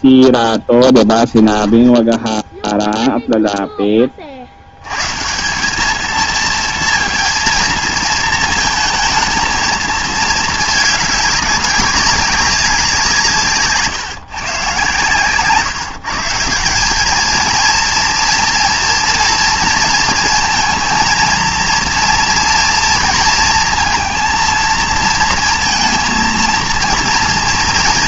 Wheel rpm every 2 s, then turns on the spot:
0, 0, 100, 230, 220, 220, 190, 130, 190, 240, 230, 230, 230, 230.
none